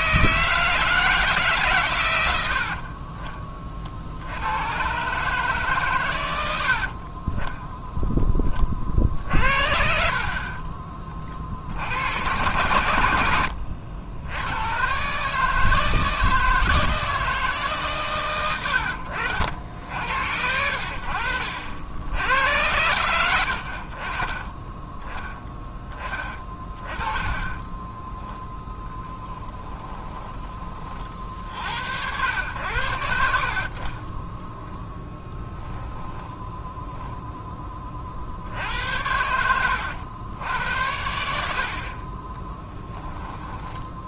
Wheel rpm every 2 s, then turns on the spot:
160, 50, 120, 70, 40, 30, 110, 120, 160, 80, 70, 100, 10, 30, 10, 30, 80, 0, 10, 80, 80, 10.
6-8 26-28